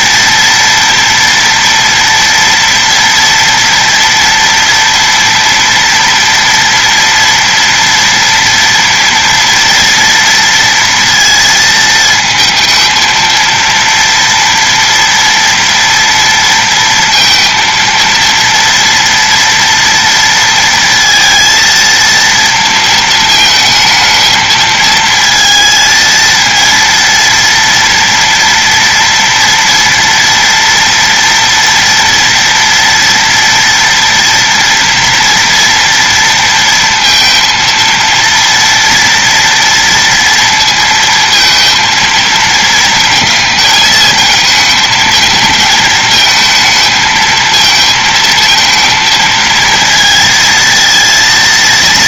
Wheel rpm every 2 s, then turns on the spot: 230, 230, 230, 230, 230, 230, 220, 230, 230, 230, 230, 230, 220, 230, 230, 230, 230, 230, 230, 230, 230, 220, 220, 220, 230, 230.
none